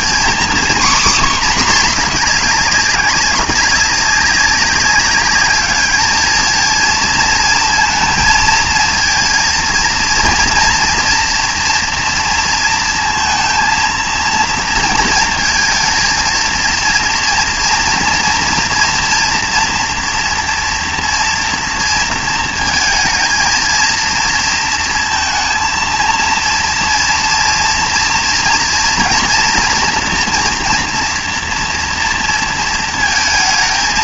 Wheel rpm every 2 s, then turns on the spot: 250, 210, 200, 220, 230, 240, 230, 230, 230, 230, 230, 220, 230, 230, 230, 230, 230.
none